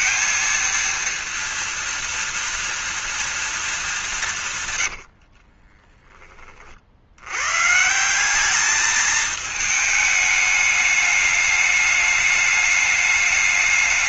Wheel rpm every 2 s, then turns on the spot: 230, 230, 160, 40, 200, 210, 210.
none